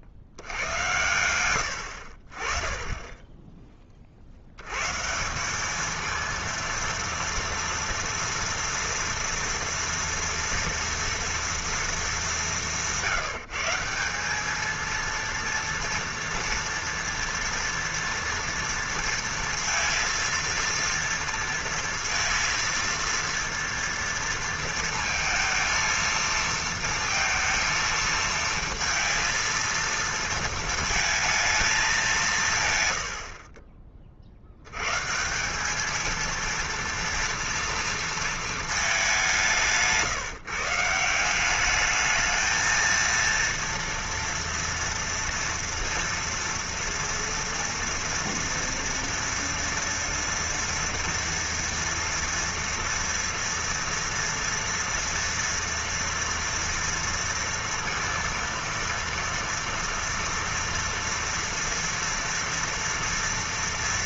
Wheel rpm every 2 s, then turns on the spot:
90, 20, 140, 230, 230, 230, 180, 230, 230, 230, 230, 230, 230, 230, 230, 230, 140, 100, 230, 220, 160, 220, 230, 230, 230, 230, 230, 230, 230, 230, 230, 230.
none